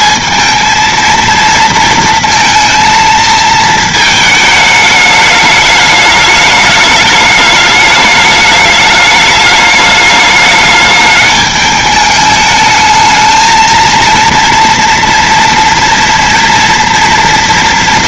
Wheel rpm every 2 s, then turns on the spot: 220, 230, 220, 210, 210, 210, 210, 230, 230.
none